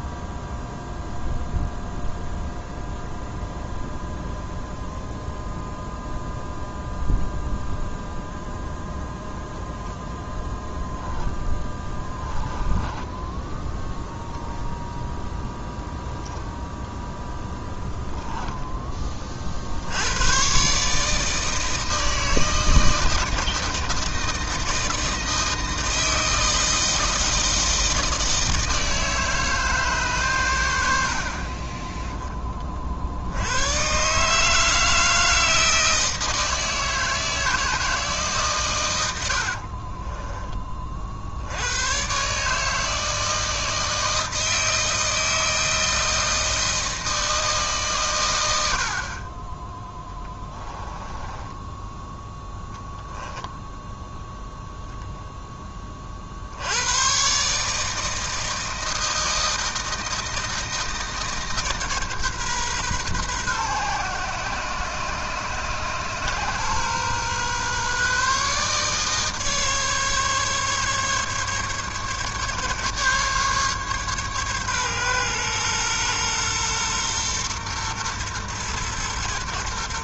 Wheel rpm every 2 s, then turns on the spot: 0, 0, 0, 0, 0, 0, 10, 0, 10, 10, 140, 160, 160, 160, 160, 90, 30, 160, 160, 110, 30, 150, 160, 160, 60, 10, 0, 0, 100, 160, 160, 130, 130, 130, 150, 140, 140, 130, 120, 120.
12-14 50-52